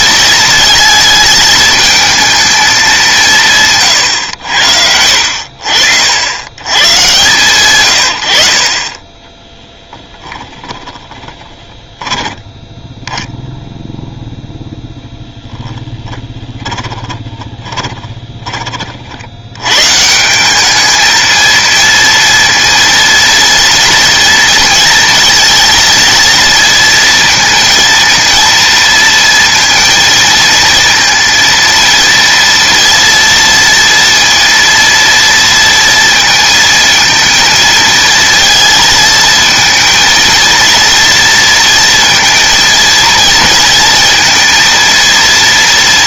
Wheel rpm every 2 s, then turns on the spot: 220, 210, 80, 100, 40, 10, 10, 0, 20, 30, 200, 230, 230, 230, 230, 230, 230, 230, 230, 230, 230, 230, 230.
10-12 16-18